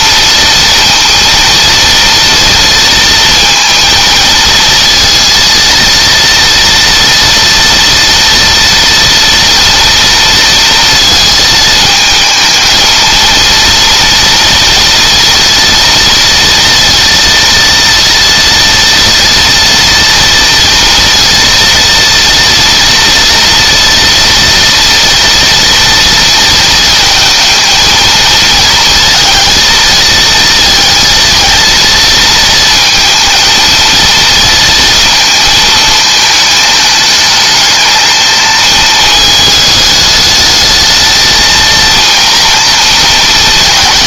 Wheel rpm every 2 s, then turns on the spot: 230, 230, 230, 230, 240, 230, 220, 230, 230, 230, 230, 230, 230, 230, 230, 220, 230, 230, 210, 220, 220, 230.
none